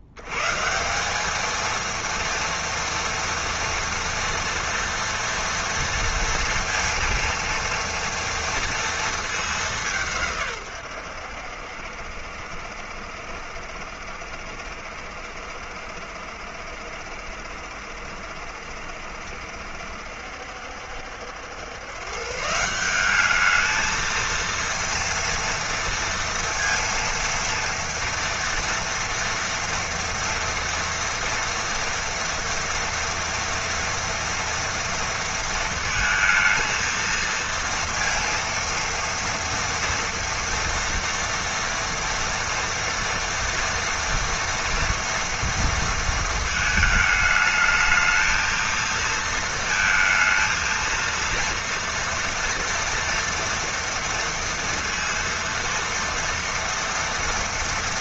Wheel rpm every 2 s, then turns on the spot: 80, 230, 240, 230, 240, 150, 70, 70, 70, 70, 70, 150, 230, 230, 230, 230, 230, 230, 230, 230, 230, 230, 240, 220, 220, 220, 230, 230, 230.
none